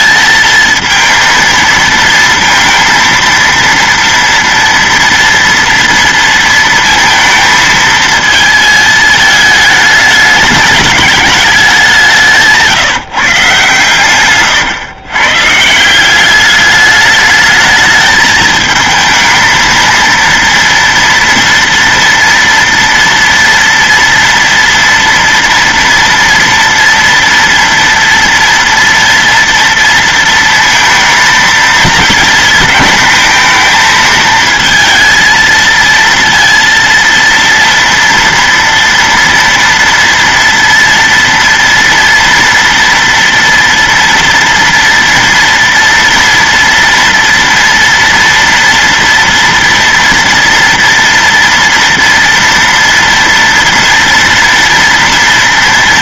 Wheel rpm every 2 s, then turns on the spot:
220, 230, 230, 230, 220, 210, 170, 130, 190, 220, 230, 230, 230, 230, 230, 230, 220, 220, 230, 240, 240, 230, 230, 230, 230, 230, 230, 230.
14-16